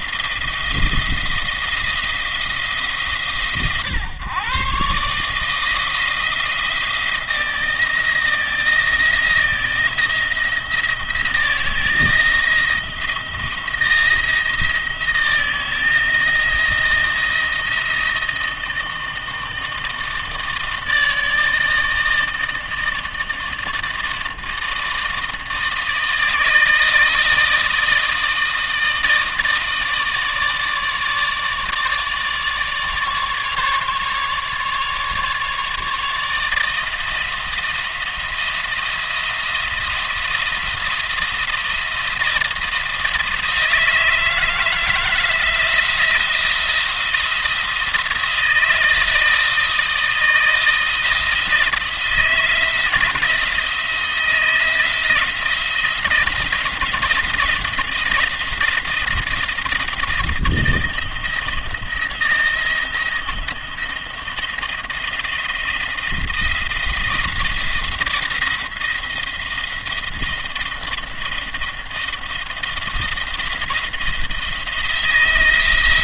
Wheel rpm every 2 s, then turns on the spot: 170, 150, 140, 170, 170, 170, 160, 170, 170, 160, 160, 160, 160, 160, 160, 150, 150, 150, 160, 170, 170, 160, 160, 170, 160, 160, 170, 170, 170, 170, 160, 170, 170, 170, 170, 170, 170, 170.
none